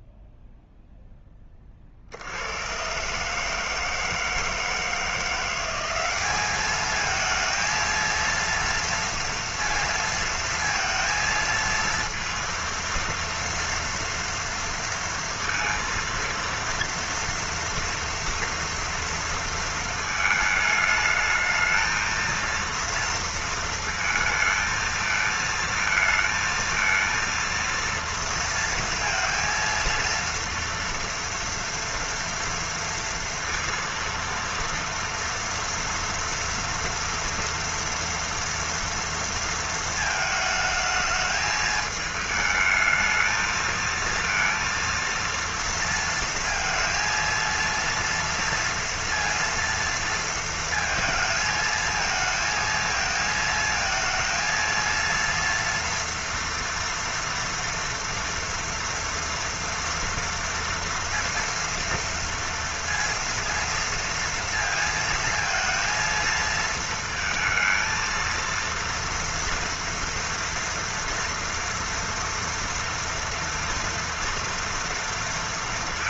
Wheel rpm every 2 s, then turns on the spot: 0, 80, 160, 200, 230, 230, 230, 230, 230, 230, 220, 230, 230, 220, 230, 230, 230, 230, 230, 230, 220, 220, 230, 230, 230, 230, 220, 230, 230, 240, 230, 230, 230, 230, 230, 230, 230, 230.
none